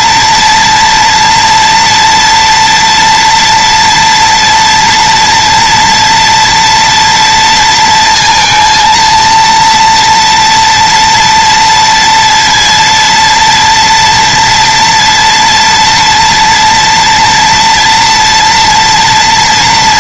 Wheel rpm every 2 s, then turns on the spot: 230, 240, 230, 230, 230, 230, 230, 230, 230, 230.
none